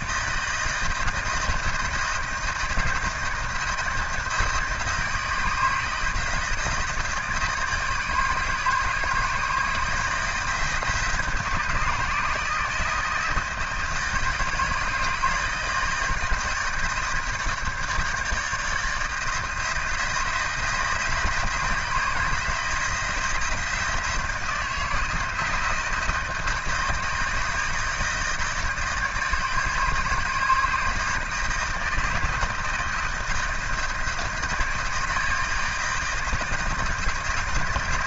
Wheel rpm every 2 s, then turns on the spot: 160, 160, 160, 160, 160, 160, 160, 160, 160, 160, 170, 160, 170, 160, 150, 150, 160, 160, 170.
none